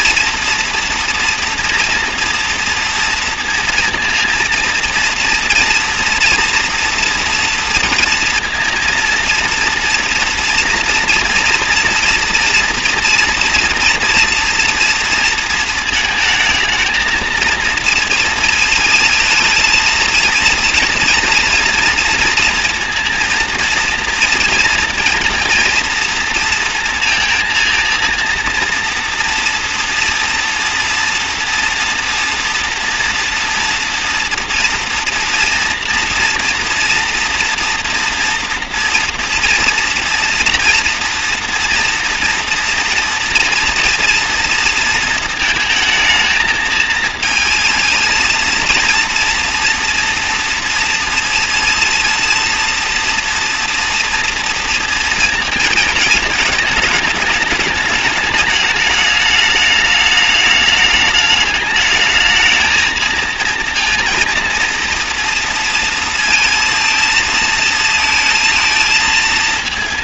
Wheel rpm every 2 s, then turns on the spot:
230, 230, 230, 230, 230, 230, 240, 240, 220, 230, 230, 230, 230, 230, 230, 240, 230, 230, 230, 240, 230, 230, 230, 220, 230, 230, 230, 230, 220, 210, 210, 230, 230, 230, 220.
none